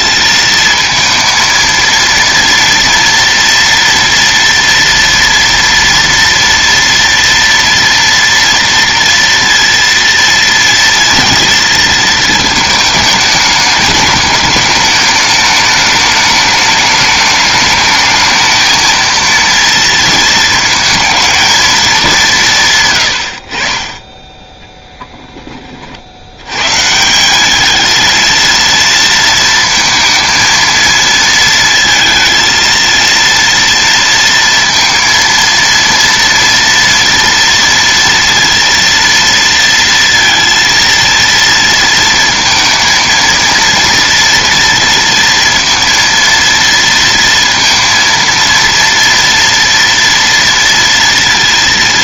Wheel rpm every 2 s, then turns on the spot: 220, 230, 230, 230, 230, 230, 220, 210, 210, 220, 220, 130, 10, 110, 230, 230, 230, 230, 230, 230, 230, 230, 230, 230, 230, 230.
22-24